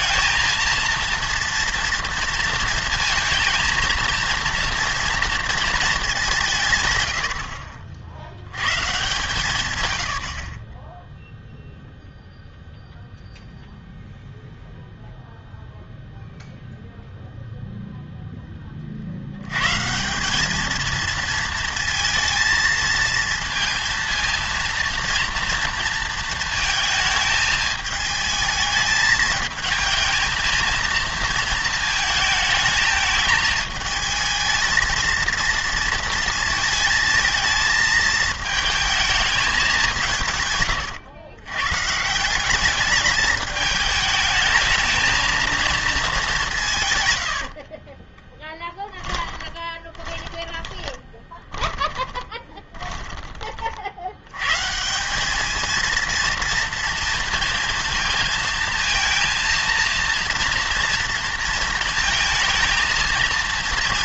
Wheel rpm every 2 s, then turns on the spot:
230, 230, 230, 140, 120, 30, 0, 0, 0, 30, 210, 230, 230, 220, 220, 230, 220, 220, 220, 220, 120, 200, 220, 160, 20, 20, 20, 140, 230, 230, 230, 220.
48-54